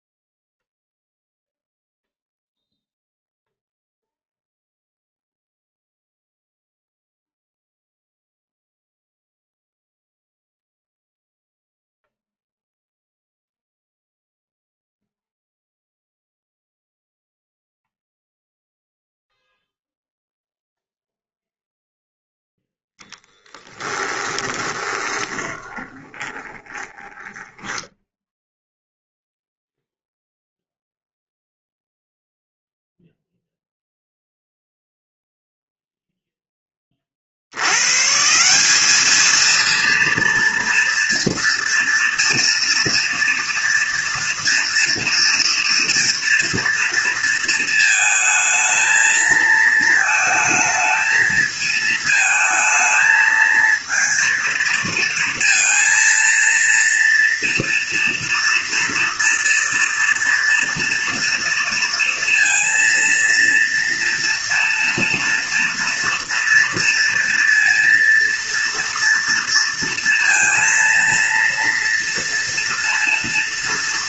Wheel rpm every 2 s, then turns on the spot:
0, 0, 0, 0, 0, 0, 0, 0, 0, 0, 0, 0, 20, 20, 0, 0, 0, 0, 30, 200, 230, 230, 230, 230, 220, 220, 220, 230, 230, 230, 230, 230, 230, 230, 230, 230, 230.
24-28